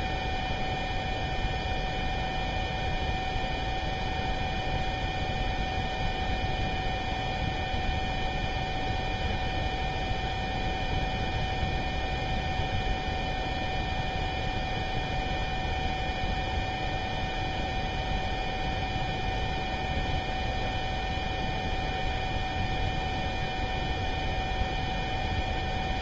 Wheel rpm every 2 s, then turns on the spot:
0, 0, 0, 0, 0, 0, 0, 0, 0, 0, 0, 0, 0.
none